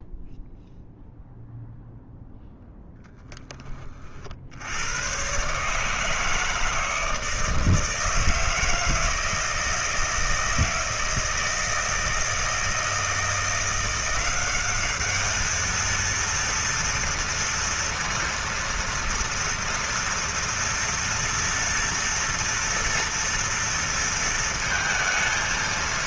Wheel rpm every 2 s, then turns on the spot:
0, 0, 80, 160, 160, 160, 160, 200, 230, 230, 230, 230, 230.
none